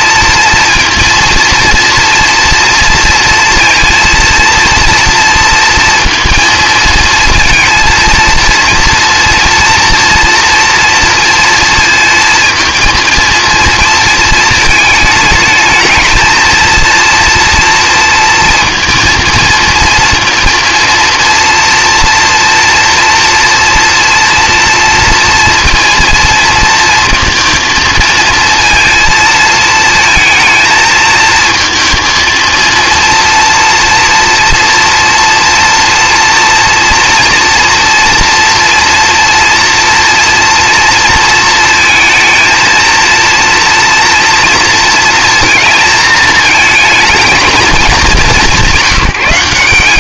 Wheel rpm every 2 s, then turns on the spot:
230, 230, 230, 230, 230, 240, 230, 220, 230, 230, 240, 230, 230, 230, 230, 230, 230, 240, 240, 230, 230, 230, 230, 220, 190.
none